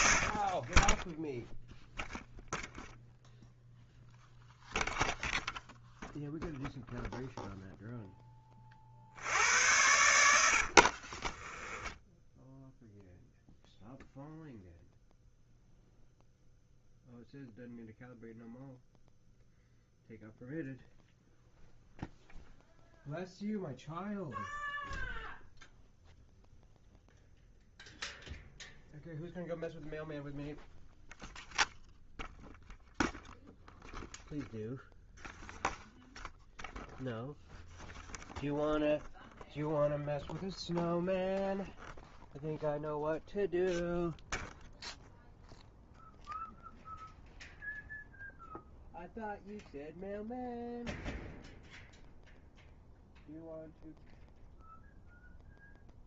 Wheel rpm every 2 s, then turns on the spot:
10, 0, 0, 0, 50, 40, 0, 0, 0, 0, 0, 0, 0, 0, 0, 0, 0, 0, 0, 0, 0, 0, 0, 0, 0, 0, 0, 0.
10-12